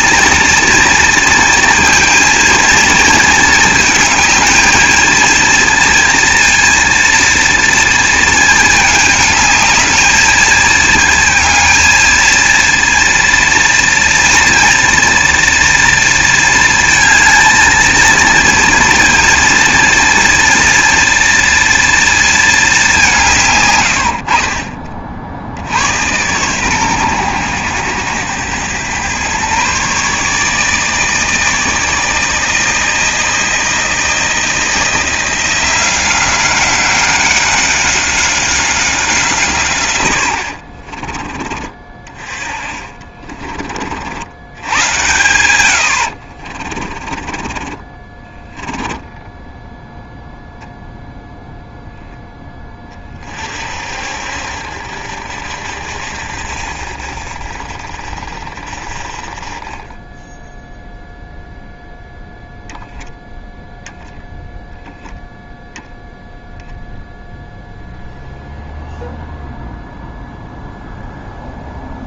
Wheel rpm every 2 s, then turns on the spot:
230, 230, 220, 230, 220, 220, 230, 230, 230, 230, 230, 210, 40, 120, 110, 150, 160, 170, 190, 190, 60, 30, 100, 40, 20, 0, 20, 60, 50, 40, 0, 0, 0, 0, 0, 0.
40-44 46-50